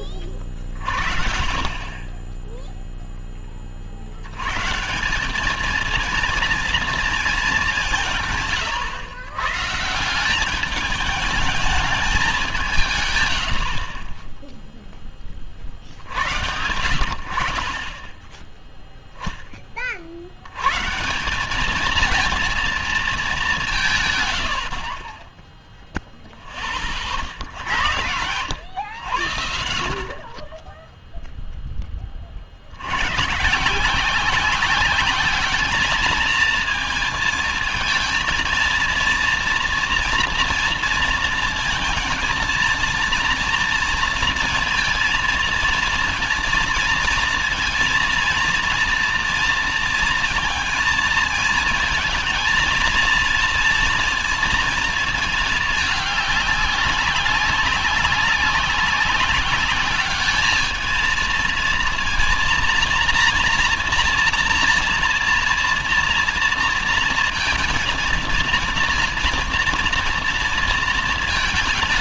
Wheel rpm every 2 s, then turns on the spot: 40, 30, 120, 230, 150, 200, 190, 10, 90, 0, 150, 220, 50, 40, 100, 10, 100, 200, 220, 230, 230, 230, 230, 230, 230, 230, 230, 230, 200, 200, 220, 230, 230, 230, 230, 230.
none